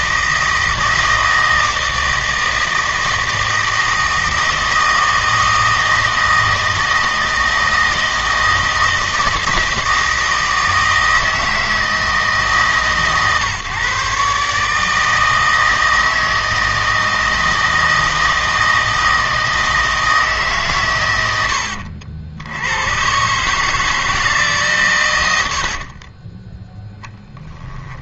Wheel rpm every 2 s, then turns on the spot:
160, 160, 160, 160, 160, 160, 150, 150, 160, 160, 130, 110, 130, 10.
26-28